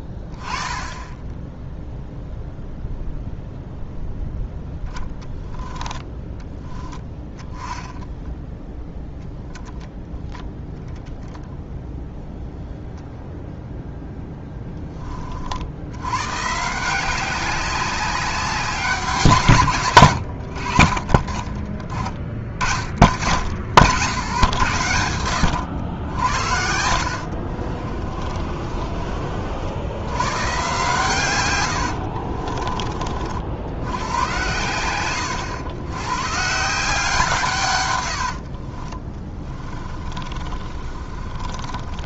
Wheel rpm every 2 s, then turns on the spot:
20, 0, 0, 20, 0, 0, 0, 10, 170, 170, 50, 60, 80, 70, 40, 130, 40, 80, 160, 30, 40.
6-8 20-22 26-30 38-42